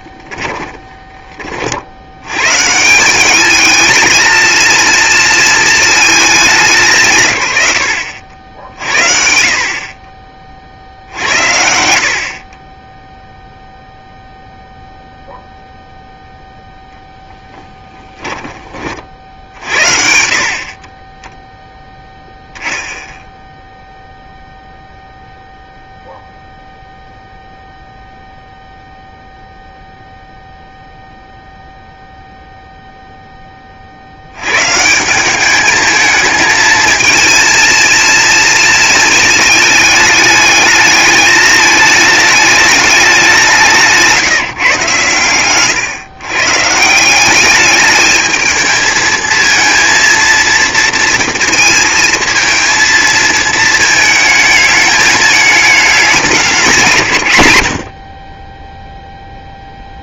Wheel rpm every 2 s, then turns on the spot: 20, 130, 230, 210, 60, 40, 40, 0, 0, 20, 60, 0, 0, 0, 0, 0, 0, 110, 220, 230, 210, 210, 160, 140, 220, 230, 220, 220, 200, 30.
0-2